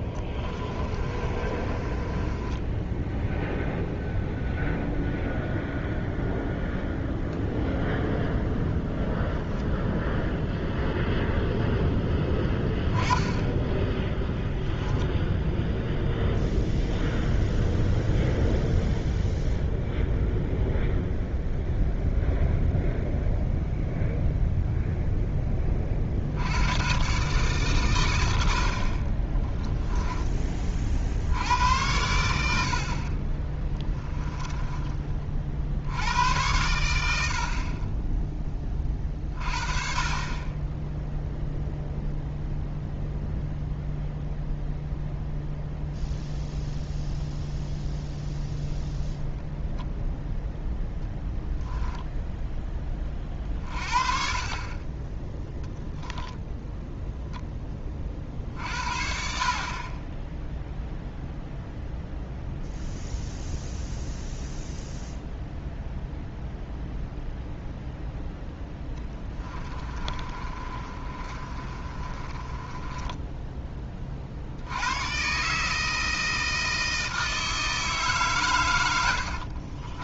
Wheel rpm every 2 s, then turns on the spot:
30, 10, 0, 0, 0, 0, 10, 0, 0, 0, 0, 0, 0, 110, 50, 40, 50, 10, 90, 30, 10, 0, 0, 0, 0, 0, 20, 30, 0, 50, 0, 0, 0, 0, 10, 30, 20, 100, 160, 90.
0-4 68-74